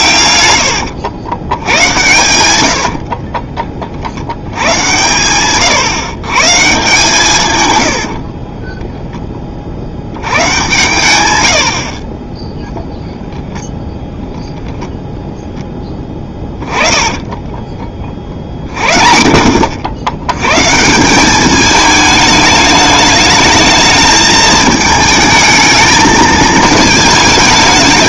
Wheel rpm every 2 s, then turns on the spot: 100, 80, 100, 140, 10, 110, 0, 0, 20, 50, 140, 210, 220, 220.
2-4 8-10 16-18